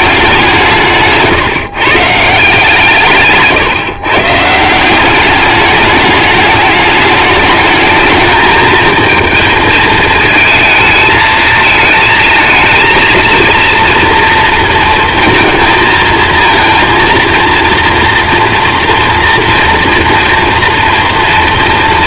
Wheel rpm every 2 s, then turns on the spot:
190, 160, 150, 210, 220, 220, 230, 230, 220, 230, 230.
none